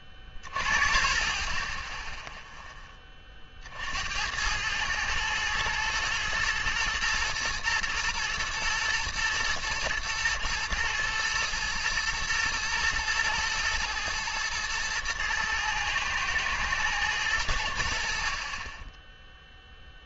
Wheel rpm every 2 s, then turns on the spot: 30, 10, 100, 110, 110, 110, 120, 110, 110, 20.
none